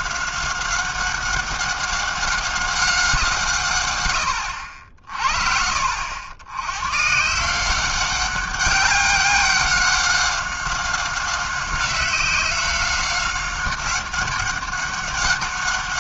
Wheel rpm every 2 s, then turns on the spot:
190, 190, 60, 120, 200, 190, 190, 200.
none